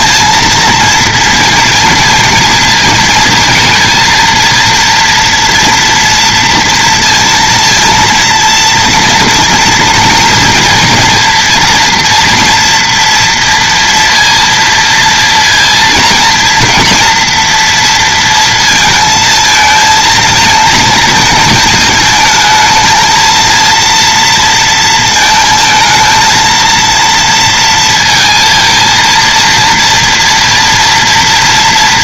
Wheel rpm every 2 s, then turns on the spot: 230, 230, 230, 230, 230, 230, 230, 230, 230, 230, 230, 220, 230, 230, 230, 230.
none